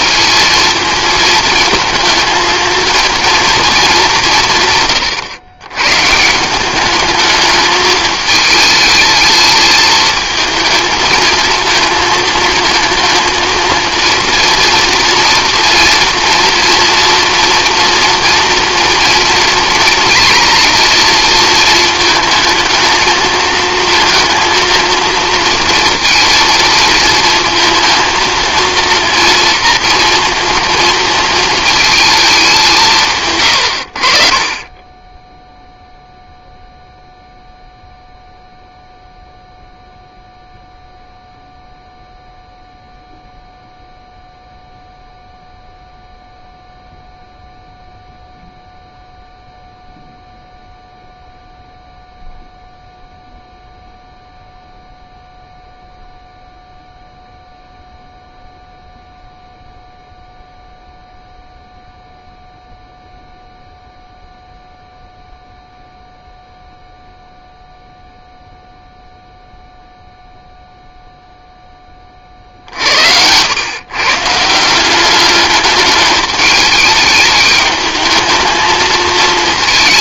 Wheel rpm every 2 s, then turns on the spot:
230, 230, 160, 200, 220, 220, 230, 230, 230, 230, 230, 220, 230, 230, 230, 230, 170, 20, 0, 0, 0, 0, 0, 0, 0, 0, 0, 0, 0, 0, 0, 0, 0, 0, 0, 0, 60, 170, 210, 220.
none